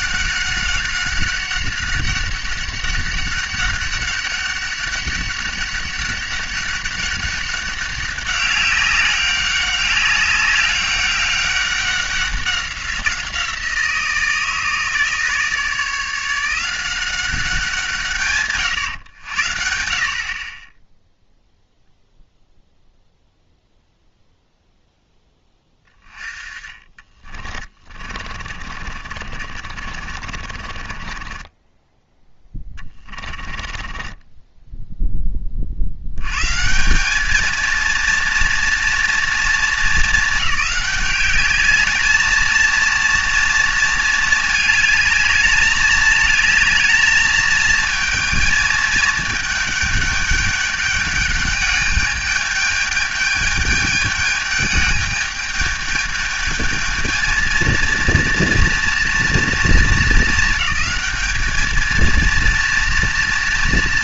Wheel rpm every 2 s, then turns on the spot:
200, 200, 200, 200, 190, 200, 190, 160, 170, 130, 10, 0, 0, 20, 40, 40, 10, 10, 170, 240, 210, 230, 220, 220, 220, 210, 210, 210, 220, 230, 210, 230.
26-36